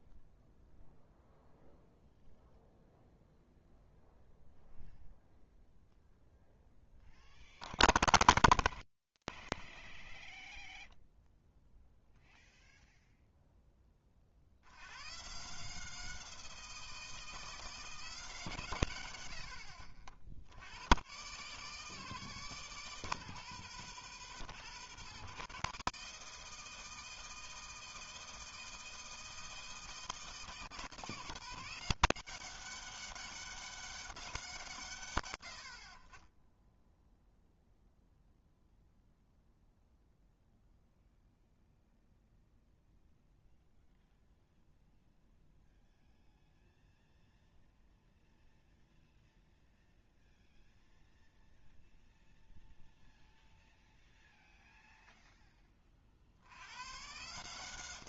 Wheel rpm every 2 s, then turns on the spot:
0, 0, 0, 0, 0, 0, 0, 60, 160, 140, 70, 160, 160, 160, 160, 160, 190, 170, 10, 0, 0, 0, 0, 0, 0, 0, 0, 0, 90.
none